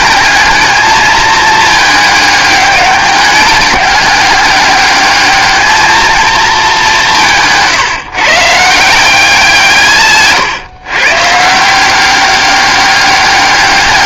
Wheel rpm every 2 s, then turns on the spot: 220, 200, 200, 200, 170, 130, 200.
none